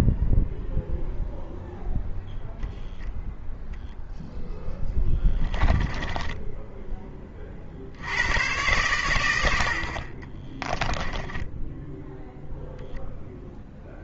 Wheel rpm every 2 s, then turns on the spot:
0, 0, 10, 10, 100, 10, 0.
4-8 10-12